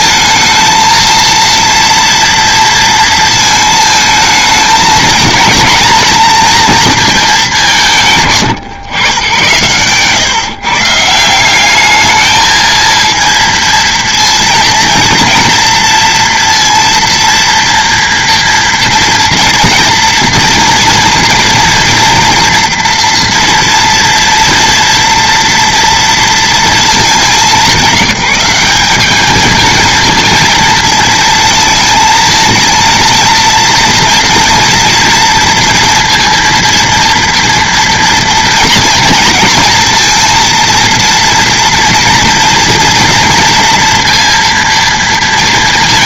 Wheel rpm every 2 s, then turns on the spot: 220, 230, 220, 230, 140, 150, 220, 230, 230, 240, 230, 230, 230, 230, 200, 220, 230, 230, 230, 240, 230, 230, 230.
none